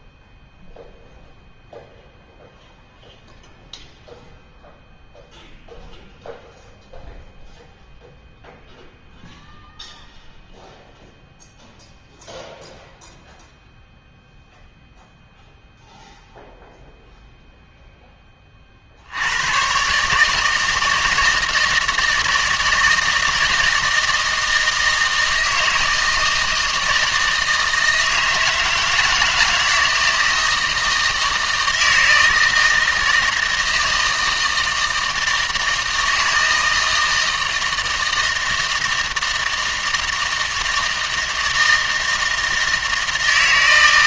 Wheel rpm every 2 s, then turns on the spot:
0, 0, 0, 0, 0, 0, 0, 0, 0, 60, 160, 160, 160, 160, 160, 160, 160, 160, 160, 160, 160, 160.
none